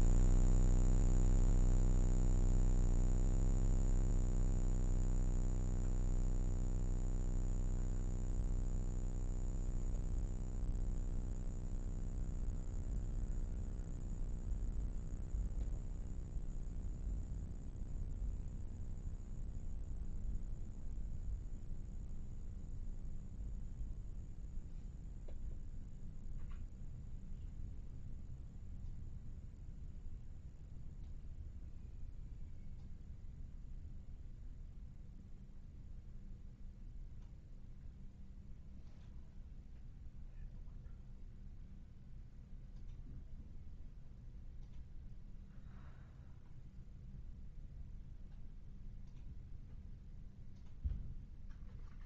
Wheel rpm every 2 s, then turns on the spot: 0, 0, 0, 0, 0, 0, 0, 0, 0, 0, 0, 0, 0, 0, 0, 0, 0, 0, 0, 0, 0, 0, 0, 0, 0, 0.
none